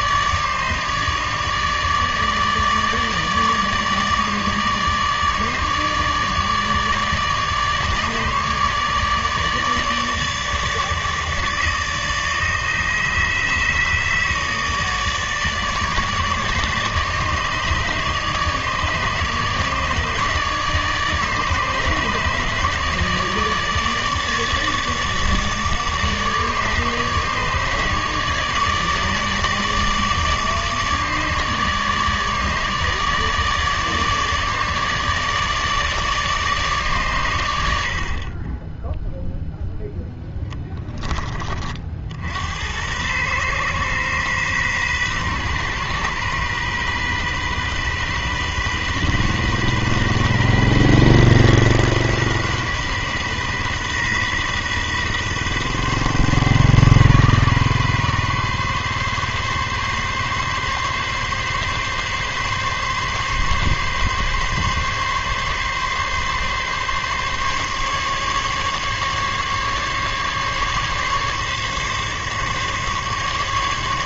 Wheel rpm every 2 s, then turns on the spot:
150, 150, 150, 150, 150, 150, 150, 150, 150, 150, 150, 150, 150, 150, 150, 150, 150, 150, 140, 10, 10, 90, 130, 130, 130, 130, 130, 130, 140, 140, 140, 140, 140, 140, 140, 140, 140.
40-42